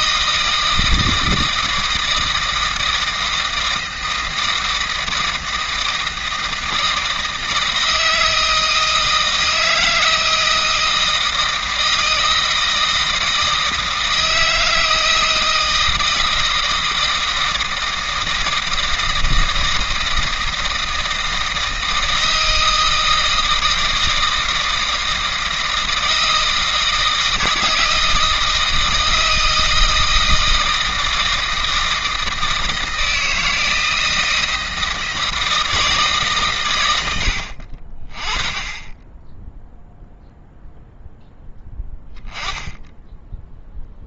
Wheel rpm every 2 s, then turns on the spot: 160, 160, 160, 160, 160, 160, 160, 160, 160, 160, 160, 160, 160, 160, 160, 160, 160, 160, 100, 10, 0, 10.
none